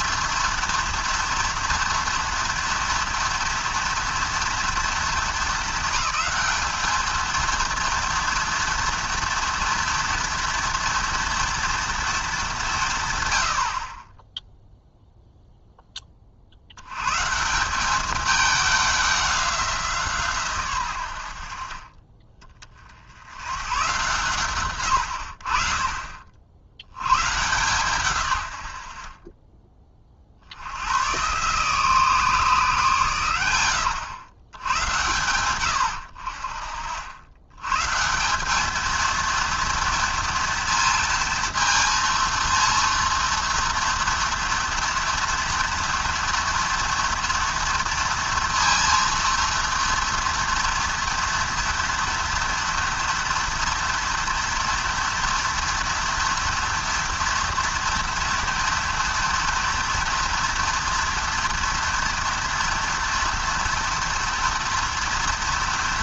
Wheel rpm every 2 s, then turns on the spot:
230, 230, 230, 220, 230, 230, 170, 0, 90, 200, 110, 30, 120, 80, 80, 90, 140, 110, 60, 210, 230, 230, 230, 230, 230, 230, 230, 230, 230, 230, 230, 230, 230.
none